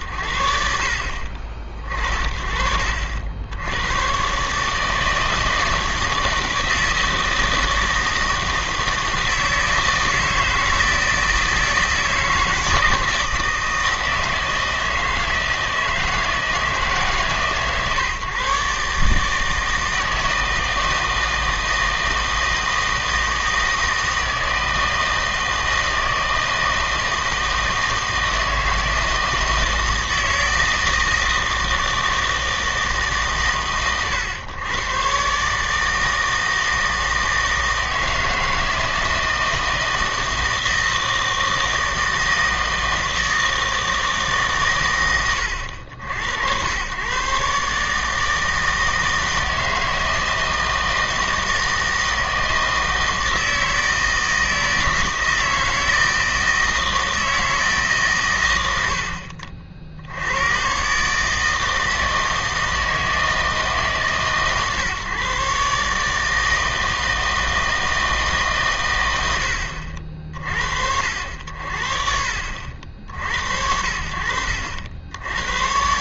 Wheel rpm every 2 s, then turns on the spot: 60, 50, 150, 160, 160, 160, 160, 160, 160, 140, 160, 160, 160, 160, 160, 160, 160, 110, 160, 160, 160, 160, 140, 100, 160, 160, 160, 160, 160, 100, 110, 160, 140, 160, 130, 60, 60, 70.
none